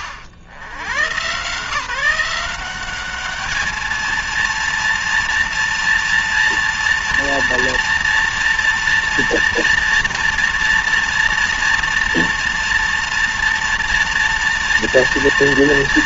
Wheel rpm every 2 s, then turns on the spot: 80, 180, 230, 230, 230, 230, 230, 230.
none